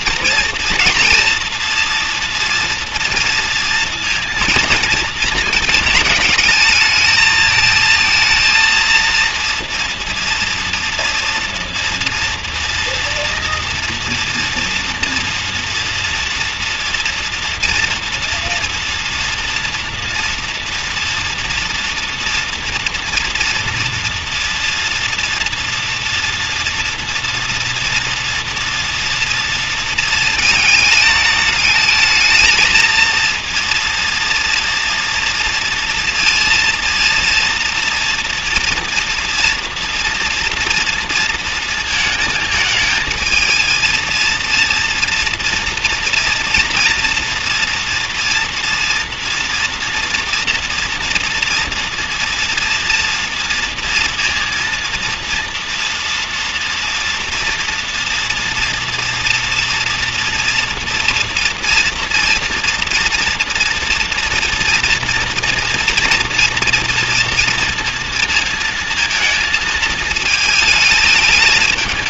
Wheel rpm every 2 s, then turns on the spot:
230, 230, 230, 210, 230, 230, 230, 230, 230, 230, 230, 230, 230, 230, 230, 220, 220, 230, 230, 230, 230, 220, 230, 230, 240, 240, 230, 230, 240, 230, 240, 230, 240, 230, 230, 220.
none